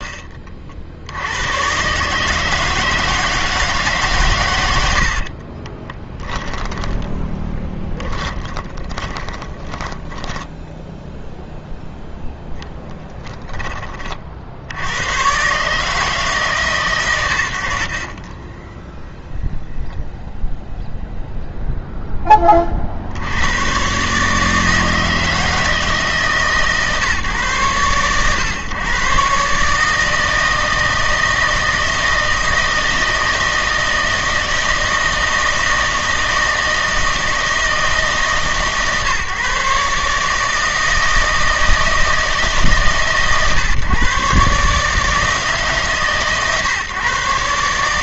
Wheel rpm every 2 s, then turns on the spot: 60, 160, 100, 10, 30, 10, 10, 60, 140, 10, 0, 50, 160, 150, 120, 160, 160, 160, 160, 150, 160, 140, 150, 140.
6-12